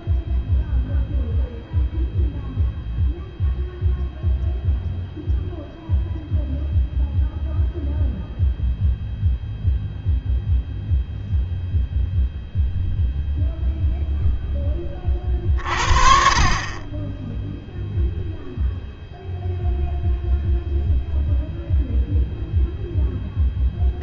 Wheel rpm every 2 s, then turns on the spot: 0, 0, 0, 0, 0, 0, 0, 10, 30, 0, 0, 0.
none